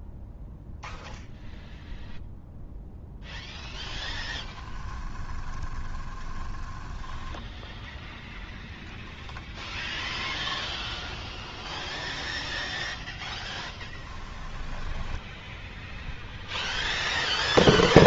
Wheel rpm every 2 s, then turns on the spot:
0, 0, 10, 10, 0, 0, 0, 10, 0.
4-8 14-16